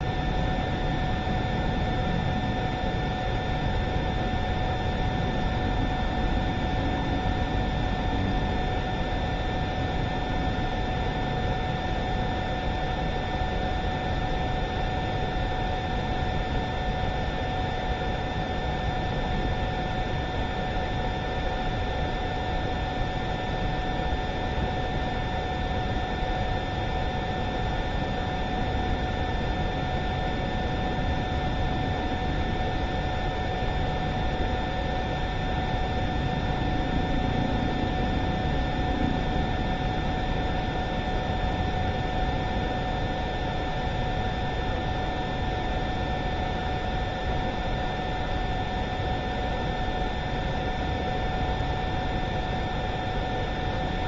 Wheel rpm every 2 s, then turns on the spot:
0, 0, 0, 0, 0, 0, 0, 0, 0, 0, 0, 0, 0, 0, 0, 0, 0, 0, 0, 0, 0, 0, 0, 0, 0, 0, 0.
none